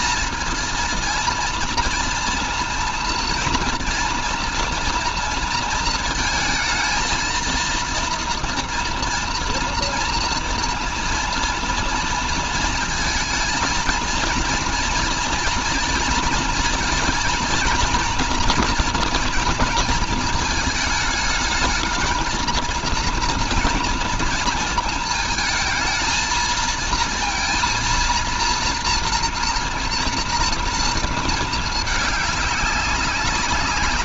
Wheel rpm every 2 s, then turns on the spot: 230, 230, 230, 220, 230, 230, 230, 230, 230, 240, 220, 230, 230, 230, 240, 230, 190.
none